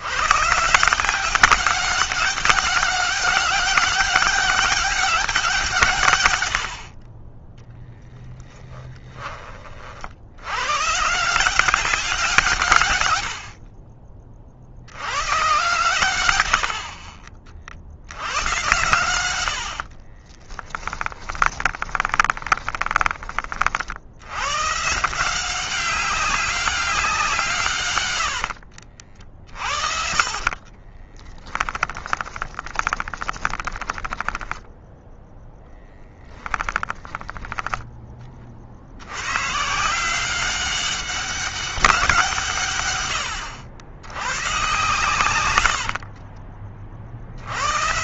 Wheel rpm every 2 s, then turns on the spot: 160, 200, 200, 60, 10, 120, 130, 60, 50, 110, 20, 20, 140, 190, 60, 20, 20, 10, 10, 70, 190, 120, 130, 40.
20-24 28-36 44-46